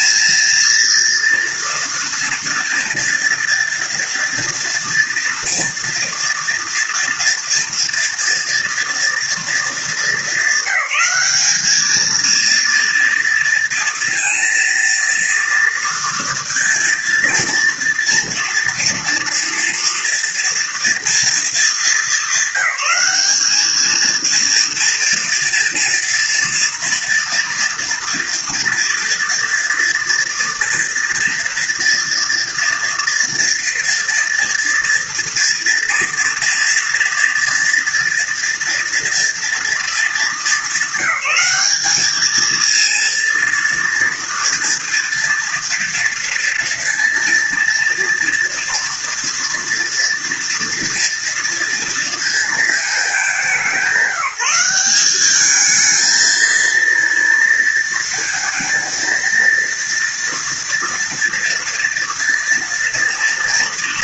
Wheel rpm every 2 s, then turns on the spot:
230, 230, 230, 230, 230, 200, 230, 230, 230, 230, 230, 200, 230, 230, 230, 230, 230, 240, 230, 230, 200, 230, 230, 230, 230, 230, 200, 200, 230, 230, 230, 230.
none